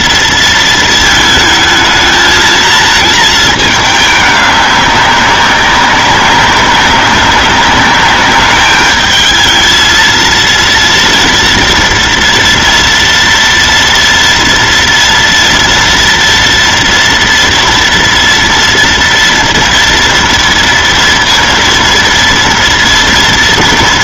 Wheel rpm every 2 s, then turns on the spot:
220, 220, 190, 200, 220, 230, 230, 230, 230, 230, 230, 230.
none